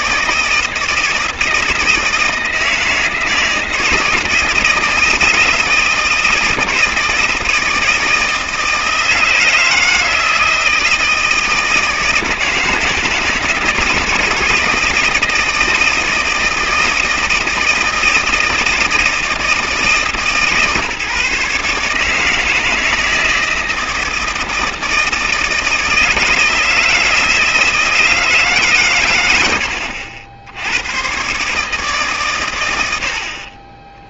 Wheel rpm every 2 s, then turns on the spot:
160, 160, 160, 160, 160, 160, 160, 160, 160, 160, 150, 160, 160, 160, 150, 90, 110.
none